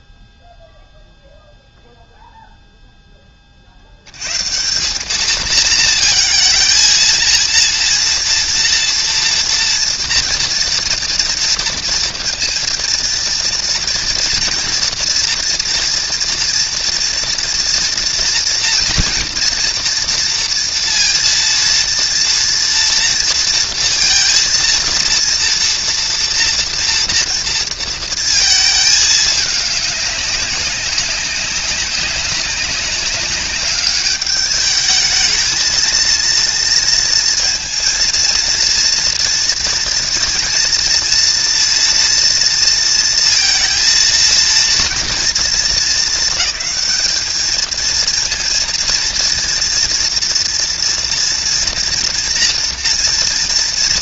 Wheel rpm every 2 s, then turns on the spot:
0, 0, 160, 230, 230, 240, 230, 230, 230, 230, 230, 230, 230, 240, 220, 190, 190, 210, 230, 230, 230, 230, 230, 220, 230, 240, 230.
none